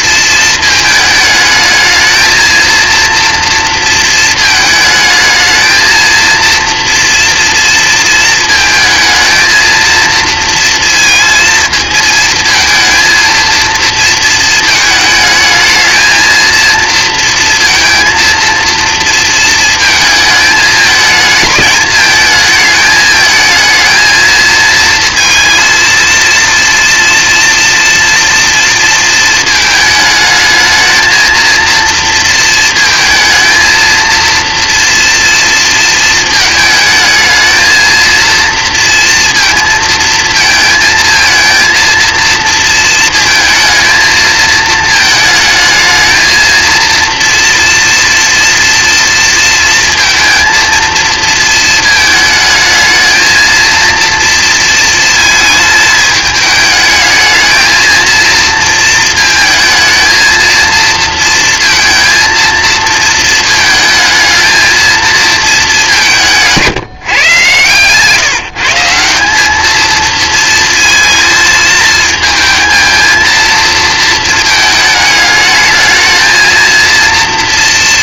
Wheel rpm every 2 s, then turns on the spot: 220, 230, 220, 230, 220, 230, 230, 220, 230, 230, 220, 220, 230, 230, 230, 220, 230, 230, 220, 230, 230, 230, 220, 230, 230, 230, 220, 230, 210, 230, 230, 230, 220, 160, 170, 220, 220, 210, 230.
none